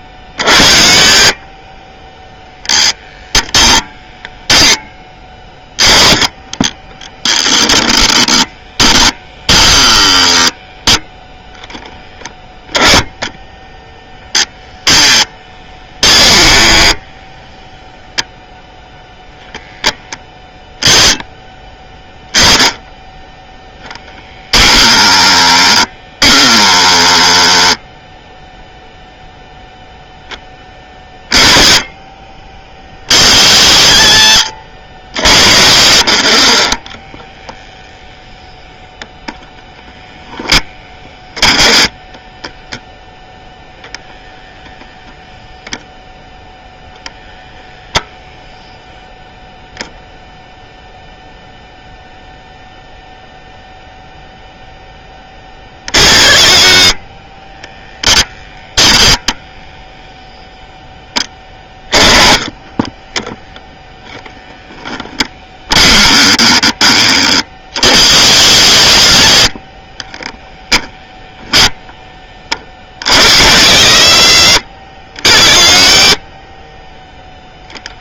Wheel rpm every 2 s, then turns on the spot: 40, 0, 10, 20, 10, 10, 10, 10, 10, 0, 10, 10, 10, 10, 0, 20, 40, 80, 20, 0, 10, 0, 0, 0, 0, 0, 0, 0, 40, 0, 0, 10, 10, 10, 60, 10, 40, 60, 20.
14-18 32-34 36-38 40-42 62-64